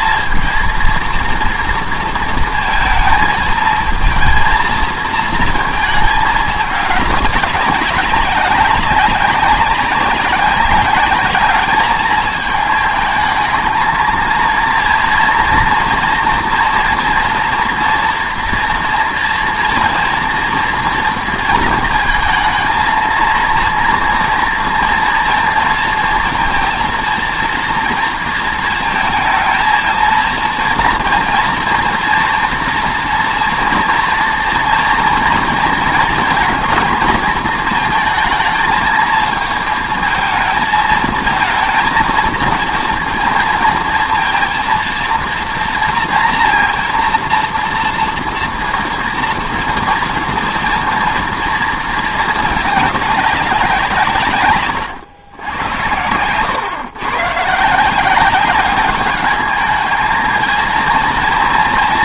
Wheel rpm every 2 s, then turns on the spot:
230, 230, 230, 210, 190, 200, 220, 230, 230, 240, 230, 220, 240, 230, 230, 230, 230, 230, 230, 220, 220, 230, 230, 230, 240, 230, 210, 120, 120, 200, 230.
54-56